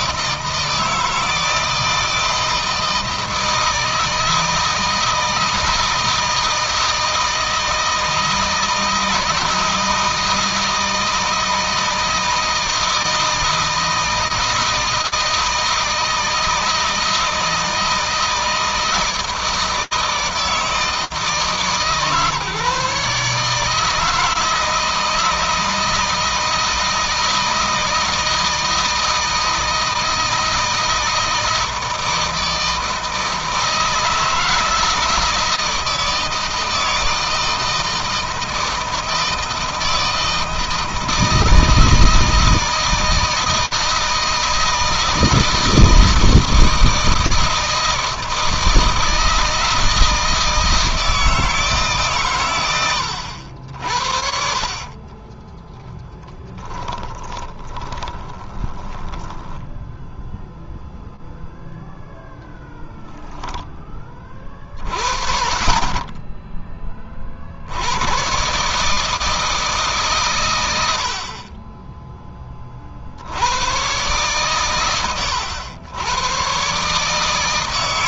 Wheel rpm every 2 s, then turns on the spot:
160, 160, 160, 160, 160, 160, 160, 160, 160, 160, 150, 150, 160, 160, 160, 160, 160, 160, 160, 160, 160, 160, 160, 160, 160, 160, 90, 30, 20, 10, 0, 0, 50, 30, 160, 50, 70, 110, 140.
54-60